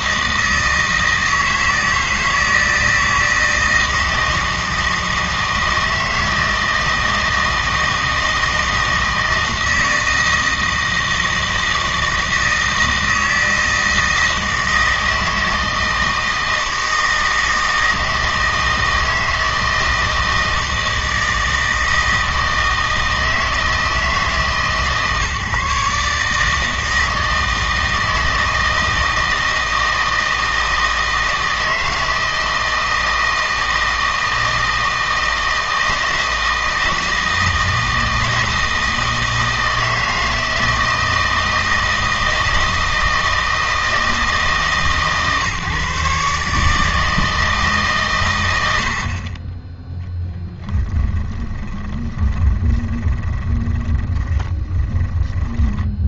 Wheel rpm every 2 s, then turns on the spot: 160, 160, 160, 160, 160, 160, 160, 160, 160, 160, 160, 160, 150, 160, 160, 160, 160, 160, 160, 160, 160, 160, 150, 150, 90, 10, 20, 20.
50-56